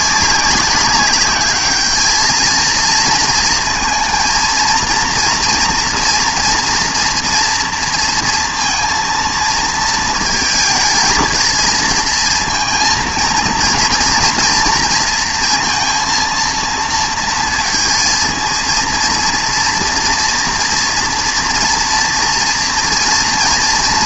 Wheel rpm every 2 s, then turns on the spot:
190, 220, 230, 240, 230, 230, 230, 230, 230, 220, 240, 230.
none